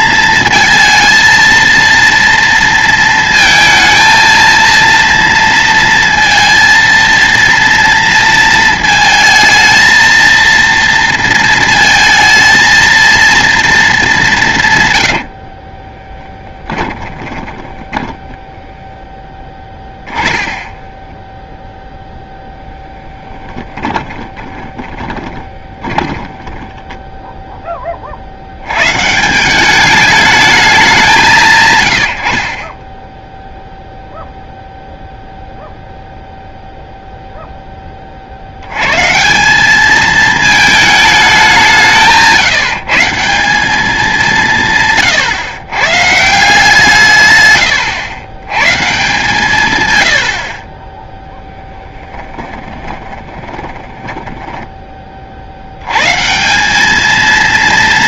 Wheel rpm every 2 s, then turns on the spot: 230, 220, 230, 230, 230, 230, 230, 80, 10, 10, 10, 0, 20, 10, 180, 170, 10, 0, 0, 170, 190, 180, 130, 160, 140, 10, 20, 50, 220.
14-22 24-26 50-54